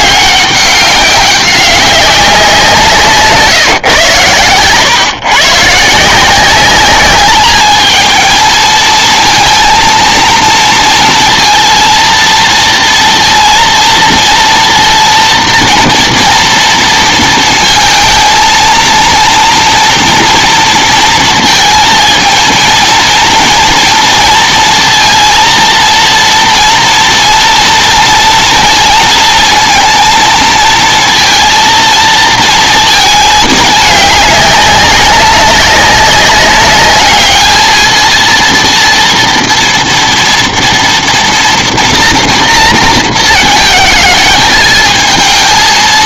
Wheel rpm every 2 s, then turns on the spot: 200, 180, 120, 190, 220, 230, 230, 230, 230, 230, 230, 230, 230, 230, 230, 230, 230, 200, 200, 230, 240, 230, 220.
none